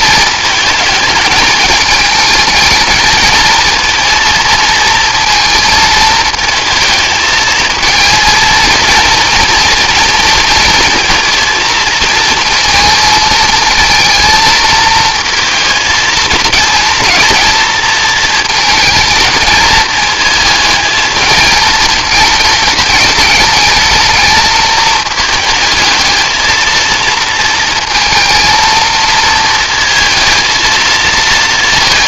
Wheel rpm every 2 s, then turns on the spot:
220, 220, 230, 220, 230, 230, 220, 230, 230, 220, 220, 210, 220, 230, 230, 230.
none